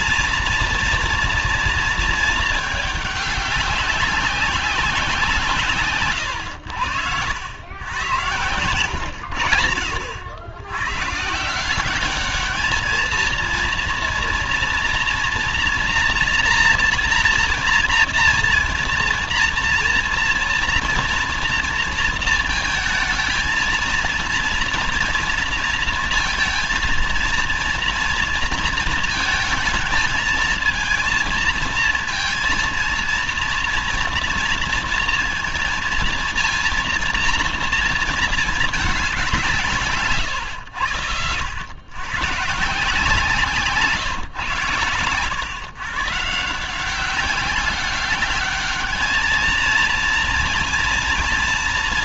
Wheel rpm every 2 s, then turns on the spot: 240, 220, 190, 110, 110, 100, 210, 240, 240, 230, 230, 230, 230, 230, 230, 230, 230, 230, 230, 220, 110, 140, 130, 170, 210, 230.
none